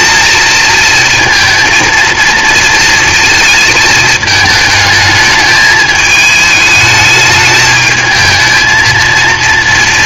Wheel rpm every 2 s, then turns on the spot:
230, 230, 220, 210, 220.
none